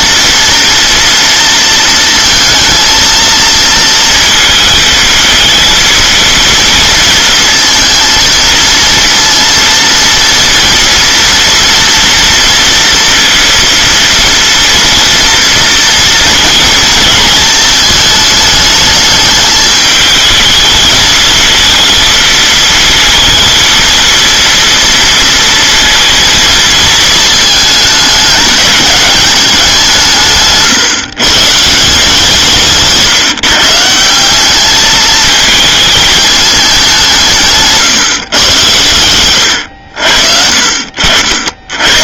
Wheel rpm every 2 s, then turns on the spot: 230, 220, 220, 230, 230, 230, 230, 230, 230, 220, 220, 230, 230, 220, 210, 140, 150, 210, 200, 100, 60.
none